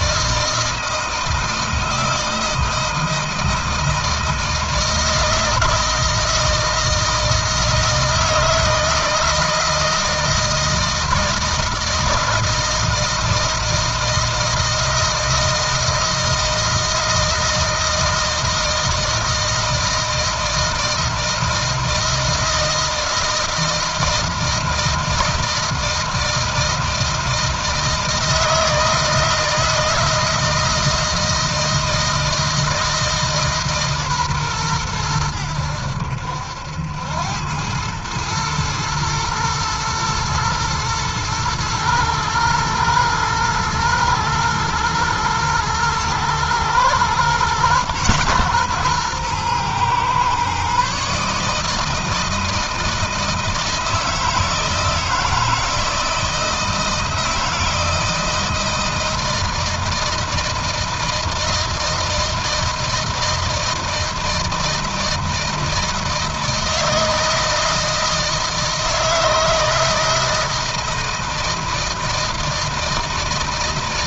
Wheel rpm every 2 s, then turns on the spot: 160, 160, 160, 160, 160, 160, 160, 160, 160, 160, 160, 160, 160, 160, 160, 160, 160, 110, 90, 110, 110, 110, 110, 120, 120, 140, 160, 160, 160, 160, 160, 160, 160, 160, 160, 160, 160.
none